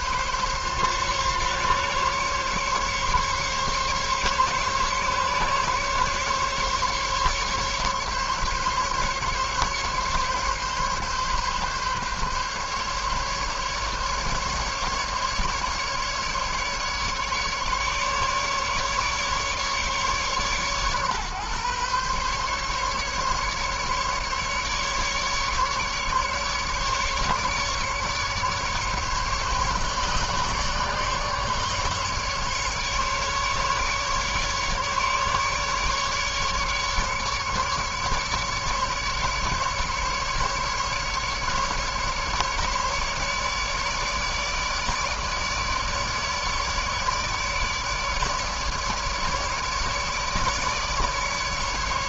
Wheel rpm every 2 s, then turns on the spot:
140, 140, 140, 140, 140, 140, 140, 140, 150, 150, 140, 140, 150, 140, 140, 150, 150, 150, 150, 150, 150, 150, 150, 150, 150, 150.
none